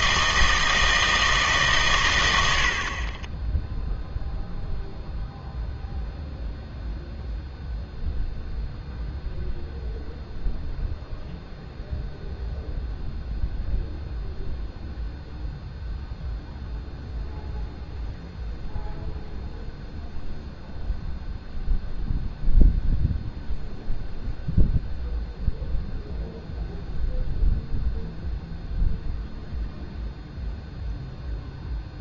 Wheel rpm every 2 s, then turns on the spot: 160, 80, 0, 0, 0, 0, 0, 0, 0, 0, 0, 0, 0, 0, 0, 0.
none